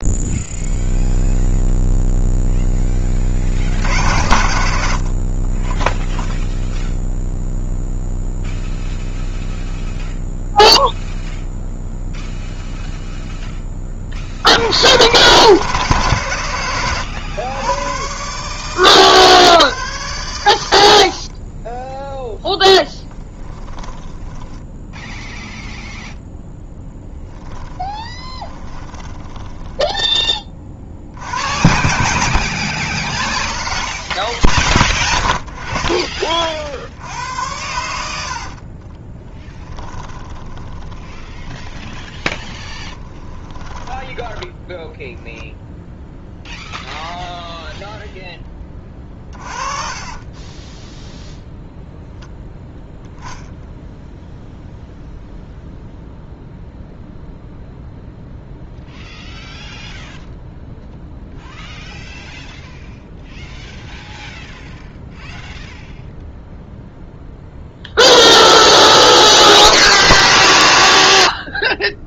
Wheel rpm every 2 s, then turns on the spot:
0, 0, 90, 0, 0, 0, 0, 70, 110, 120, 90, 0, 10, 0, 20, 30, 80, 20, 40, 70, 10, 10, 10, 0, 10, 20, 0, 0, 0, 0, 0, 0, 0, 0, 100, 120.
24-26 28-30 40-44 50-52